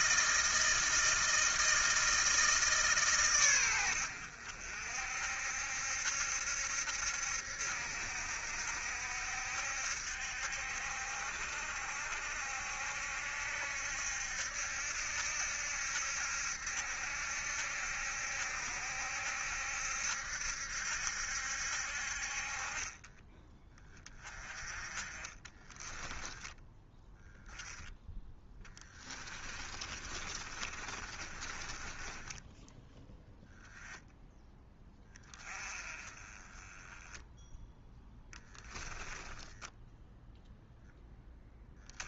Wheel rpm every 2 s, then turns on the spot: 160, 140, 60, 70, 70, 60, 70, 70, 70, 70, 70, 30, 20, 10, 20, 30, 10, 20, 10, 10, 0.
24-26 28-32 38-40